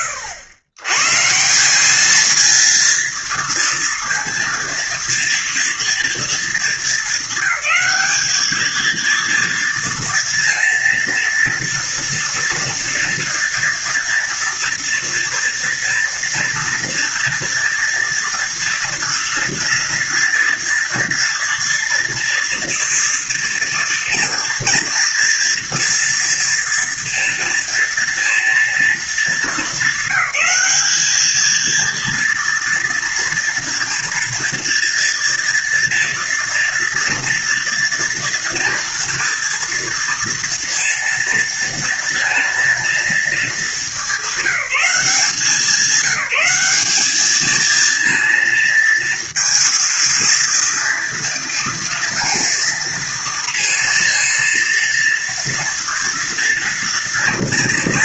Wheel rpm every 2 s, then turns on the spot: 110, 230, 230, 220, 220, 230, 240, 230, 230, 230, 230, 230, 230, 230, 230, 210, 230, 230, 240, 230, 230, 230, 190, 200, 230, 230, 230, 230, 230.
none